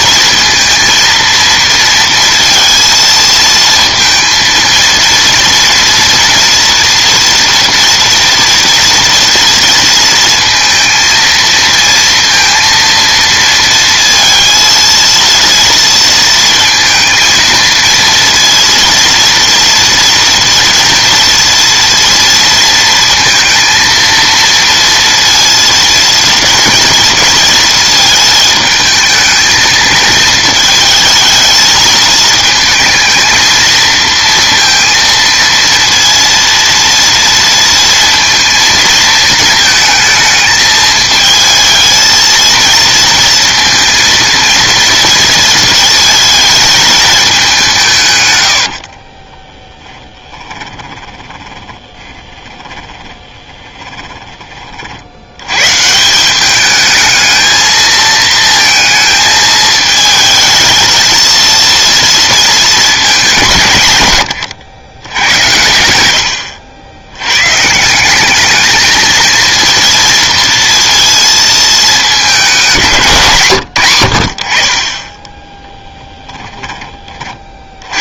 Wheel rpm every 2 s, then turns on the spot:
230, 230, 230, 230, 230, 230, 230, 230, 230, 230, 230, 230, 230, 230, 220, 220, 220, 230, 230, 220, 220, 230, 230, 210, 60, 30, 10, 50, 210, 220, 220, 220, 120, 80, 220, 230, 190, 40, 20.
48-54